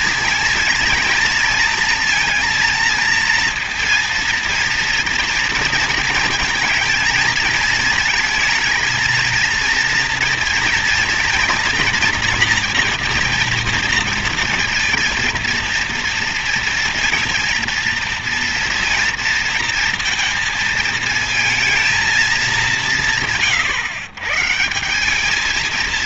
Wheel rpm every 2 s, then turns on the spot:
230, 230, 230, 220, 230, 230, 230, 230, 230, 230, 230, 180, 180.
none